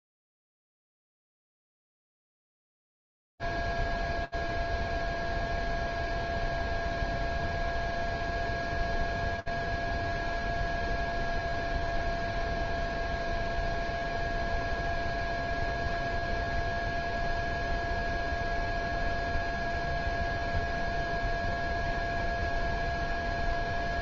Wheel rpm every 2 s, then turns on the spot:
0, 0, 0, 0, 0, 0, 0, 0, 0, 0, 0, 0.
none